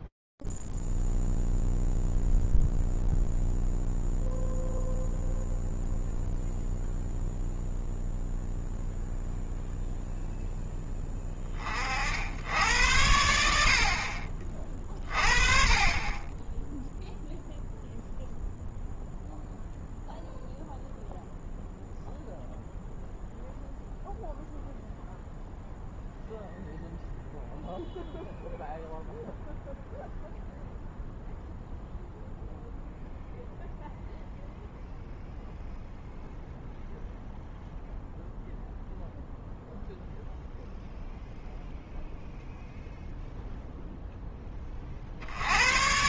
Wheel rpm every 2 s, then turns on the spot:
0, 0, 0, 0, 0, 0, 60, 50, 20, 0, 0, 0, 0, 0, 0, 0, 0, 0, 0, 0, 0, 0, 30.
none